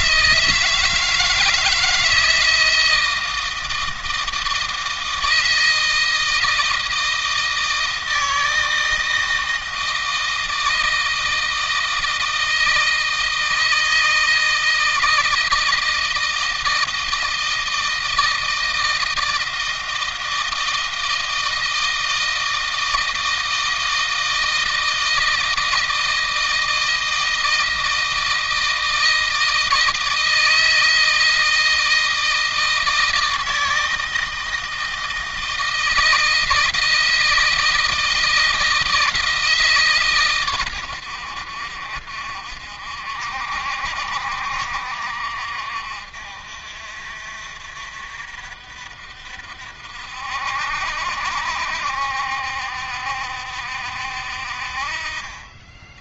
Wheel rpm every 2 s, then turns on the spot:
160, 160, 160, 160, 160, 160, 160, 160, 160, 160, 160, 160, 160, 160, 160, 160, 160, 160, 160, 160, 100, 50, 50, 60, 60, 60, 60, 40.
none